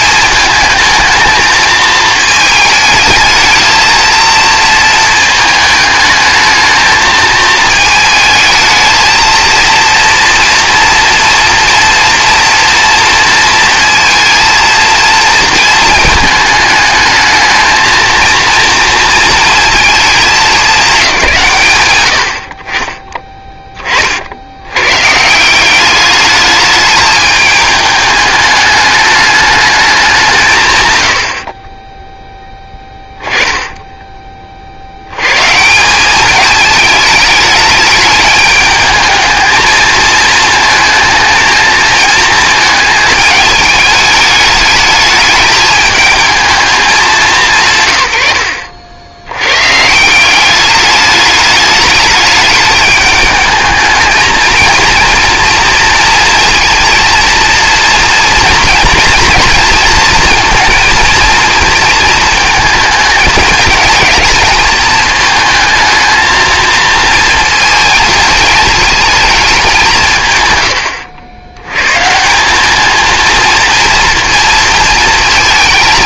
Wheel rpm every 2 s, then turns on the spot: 230, 220, 220, 220, 220, 230, 230, 230, 220, 230, 210, 70, 100, 210, 210, 140, 10, 60, 220, 210, 230, 220, 210, 200, 70, 200, 210, 230, 230, 230, 220, 220, 220, 230, 220, 110, 200, 230.
32-34